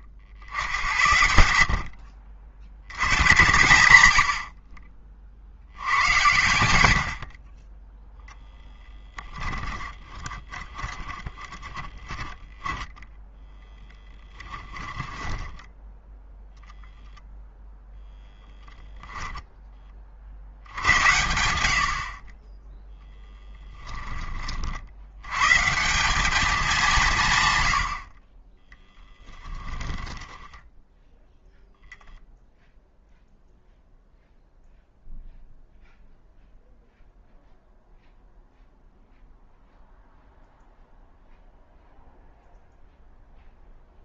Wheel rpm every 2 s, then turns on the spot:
70, 80, 40, 90, 10, 20, 10, 20, 0, 0, 70, 10, 60, 210, 10, 10, 0, 0, 0, 0, 0, 0.
10-12 14-16 28-32